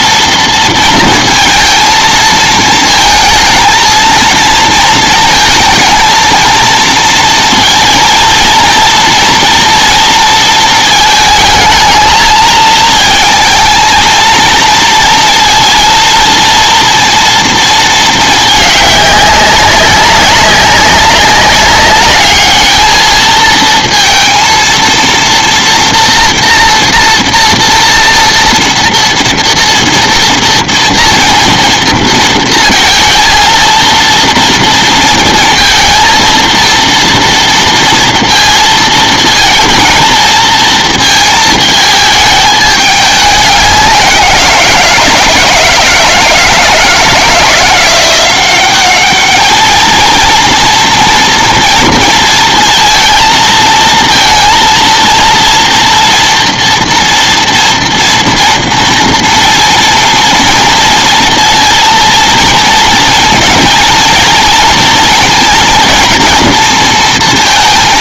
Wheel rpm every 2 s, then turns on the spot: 230, 220, 230, 230, 230, 220, 220, 230, 230, 200, 200, 220, 230, 230, 230, 230, 220, 230, 230, 230, 230, 210, 170, 170, 200, 230, 230, 230, 230, 230, 230, 230, 230, 230.
none